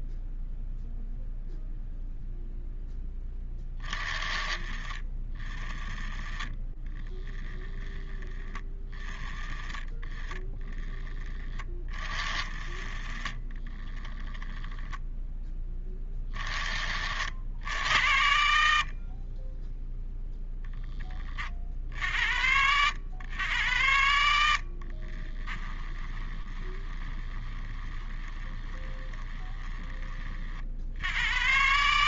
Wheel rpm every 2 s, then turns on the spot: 0, 10, 50, 10, 30, 10, 40, 10, 60, 40, 20, 90, 40, 20, 20, 70.
24-30